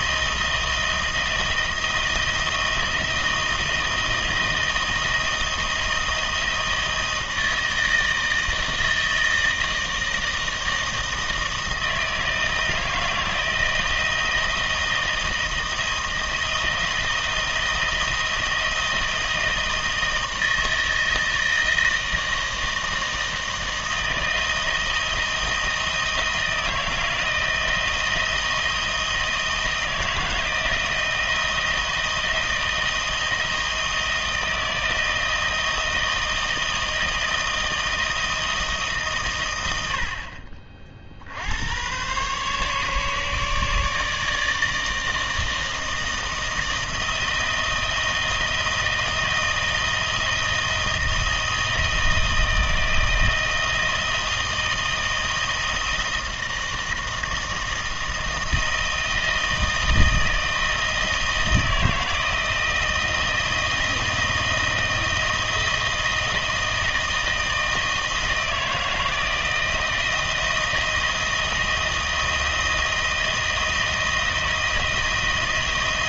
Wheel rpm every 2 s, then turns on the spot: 170, 160, 160, 160, 160, 160, 160, 170, 170, 170, 160, 160, 160, 160, 160, 160, 160, 160, 160, 160, 50, 140, 160, 160, 160, 160, 160, 160, 160, 160, 160, 160, 160, 160, 160, 160, 160, 160.
none